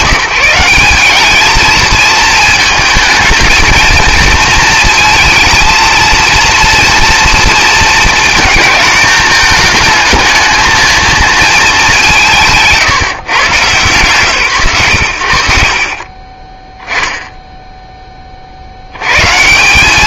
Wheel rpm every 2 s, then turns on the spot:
180, 220, 230, 230, 210, 220, 200, 100, 10, 40.
none